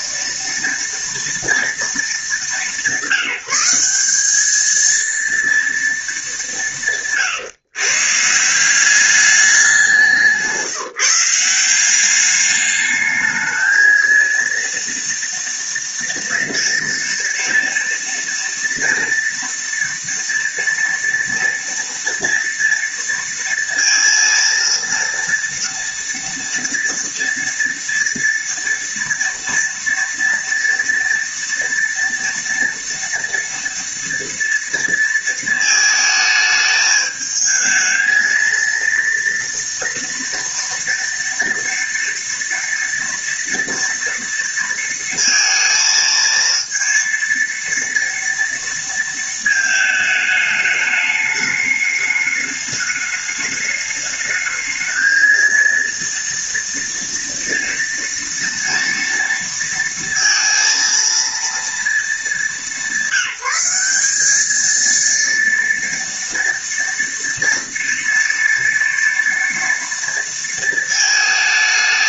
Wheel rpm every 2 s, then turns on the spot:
230, 180, 220, 160, 190, 170, 210, 230, 230, 230, 230, 230, 230, 230, 240, 230, 230, 230, 210, 230, 230, 230, 230, 230, 230, 210, 210, 220, 230, 230, 230, 190, 220, 230, 230, 220.
none